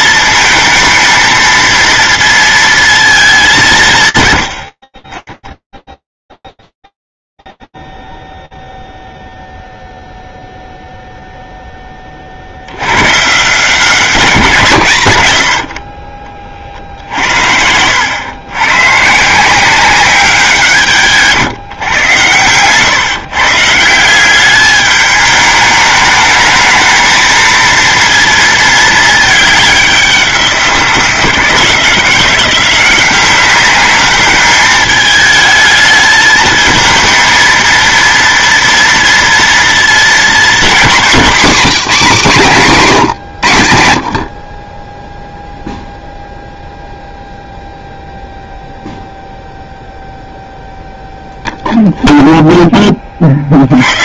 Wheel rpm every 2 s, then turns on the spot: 230, 220, 30, 0, 0, 0, 90, 130, 60, 150, 160, 140, 210, 220, 210, 170, 180, 220, 220, 230, 220, 120, 0, 0, 0, 0, 30.
none